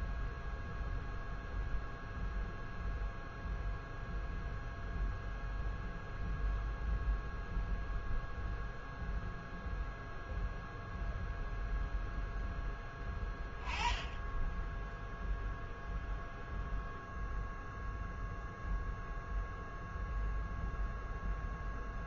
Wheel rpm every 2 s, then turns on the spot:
0, 0, 0, 0, 0, 0, 0, 0, 0, 0, 0.
none